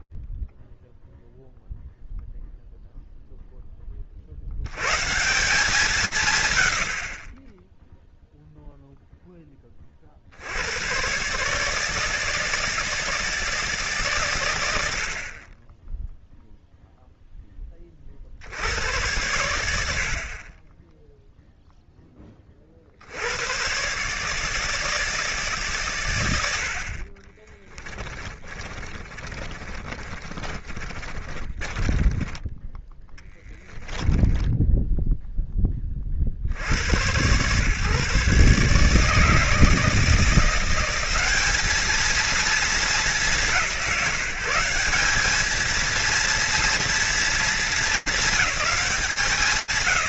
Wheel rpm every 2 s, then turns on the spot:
0, 0, 130, 100, 10, 140, 160, 50, 10, 100, 0, 100, 160, 40, 30, 30, 10, 10, 110, 160, 210, 190, 200, 230, 200.
26-32